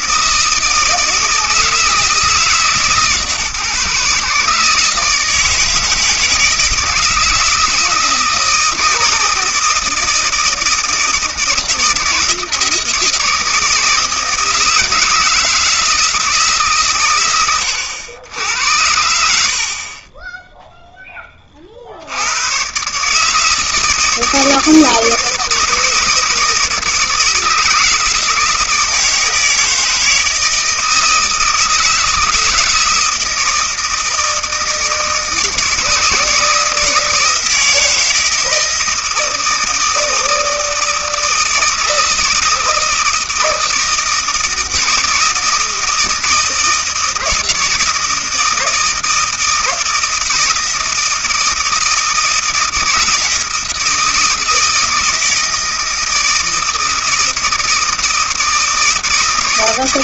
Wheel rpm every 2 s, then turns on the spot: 160, 150, 150, 160, 160, 160, 160, 160, 150, 90, 0, 120, 160, 160, 160, 160, 160, 160, 160, 160, 160, 160, 160, 160, 160, 160, 160, 160, 160, 160.
none